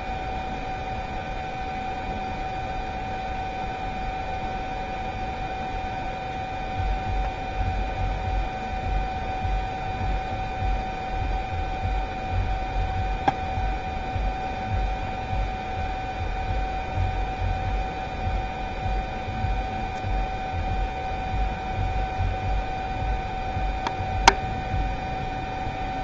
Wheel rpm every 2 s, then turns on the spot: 0, 0, 0, 0, 0, 0, 0, 0, 0, 0, 0, 0, 0.
none